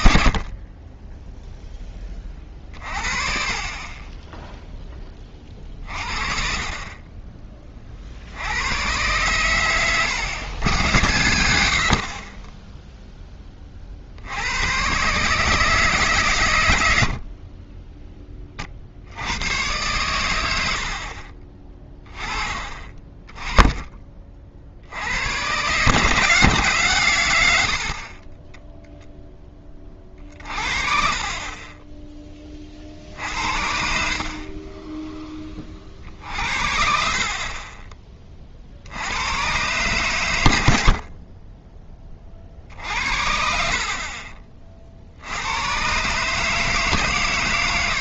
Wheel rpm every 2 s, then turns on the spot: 30, 40, 10, 40, 80, 110, 10, 100, 110, 30, 90, 30, 50, 140, 10, 60, 30, 30, 60, 50, 90, 50, 40, 150.
none